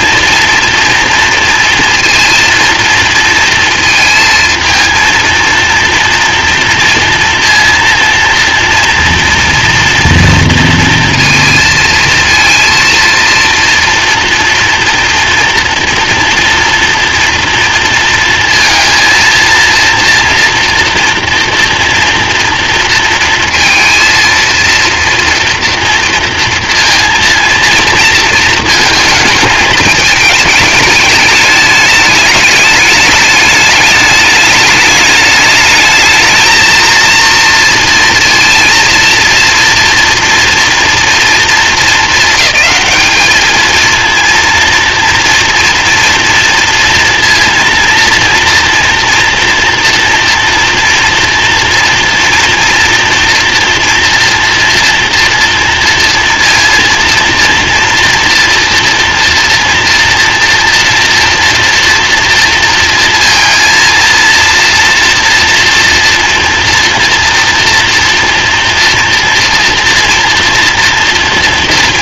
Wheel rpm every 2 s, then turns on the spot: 230, 230, 230, 230, 230, 230, 230, 230, 230, 230, 230, 230, 230, 230, 220, 210, 210, 210, 230, 230, 230, 210, 230, 230, 230, 230, 230, 230, 230, 230, 230, 230, 240, 230, 240, 230.
none